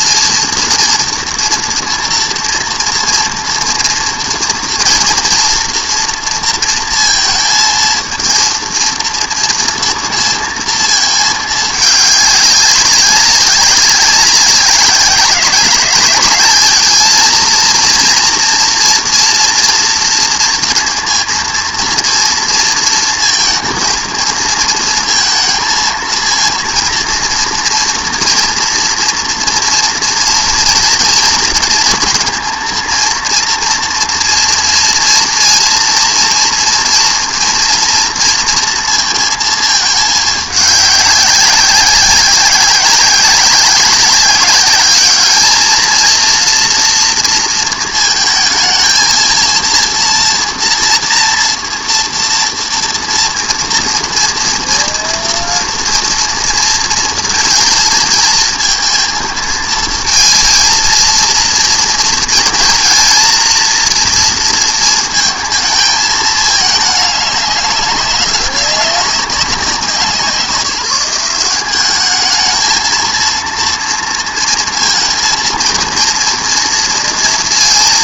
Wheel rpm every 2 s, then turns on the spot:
230, 230, 240, 230, 230, 230, 200, 190, 210, 230, 230, 230, 230, 230, 240, 230, 230, 230, 230, 230, 200, 190, 200, 230, 220, 230, 230, 230, 230, 220, 230, 230, 230, 210, 200, 180, 220, 230, 230.
none